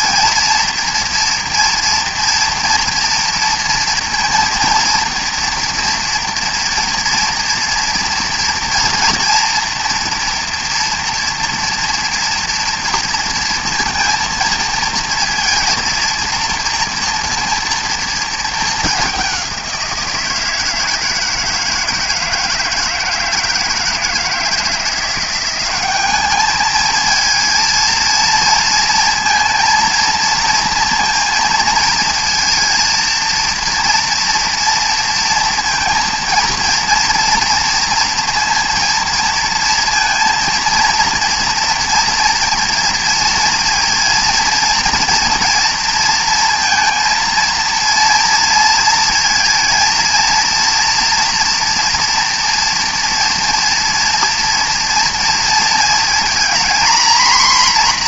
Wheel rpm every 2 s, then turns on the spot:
230, 240, 230, 230, 240, 230, 230, 230, 230, 200, 160, 160, 170, 220, 230, 230, 230, 230, 230, 230, 230, 240, 240, 230, 230, 240, 230, 230, 240.
none